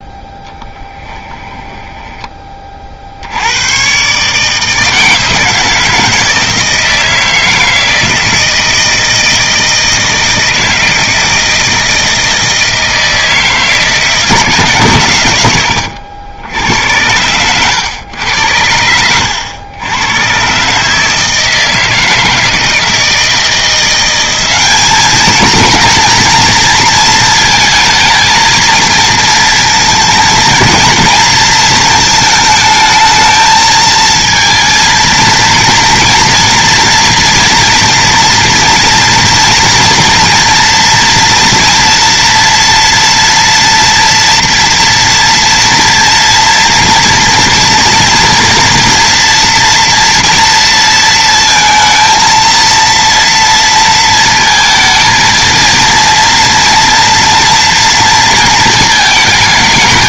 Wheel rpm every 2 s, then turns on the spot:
10, 70, 160, 160, 160, 160, 160, 130, 90, 90, 150, 160, 210, 230, 230, 230, 220, 230, 240, 240, 240, 230, 240, 230, 230, 230, 230, 220, 230, 220.
0-2